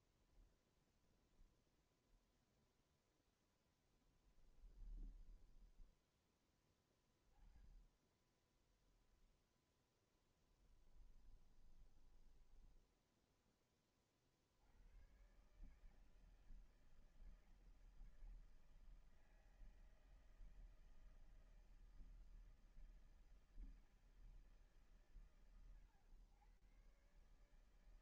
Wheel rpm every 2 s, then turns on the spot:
0, 0, 0, 20, 10, 20, 20, 140, 160, 160, 160, 160, 120, 140.
8-12